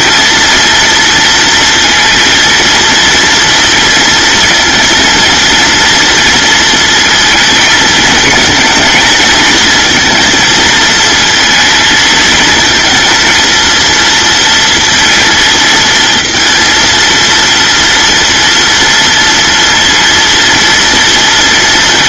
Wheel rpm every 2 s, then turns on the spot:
230, 230, 230, 230, 230, 230, 230, 230, 230, 230, 240.
none